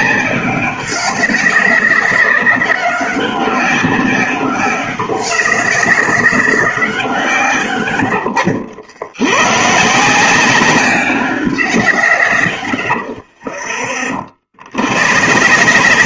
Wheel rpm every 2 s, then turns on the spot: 190, 190, 200, 170, 70, 190, 90, 70.
none